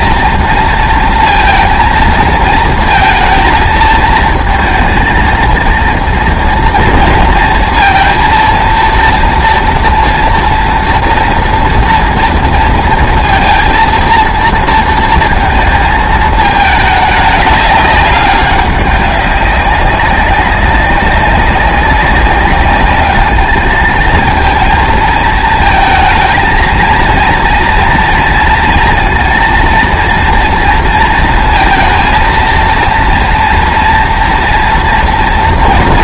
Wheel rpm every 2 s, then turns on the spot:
230, 230, 230, 230, 230, 230, 230, 230, 220, 200, 190, 200, 230, 230, 230, 230, 230, 230.
none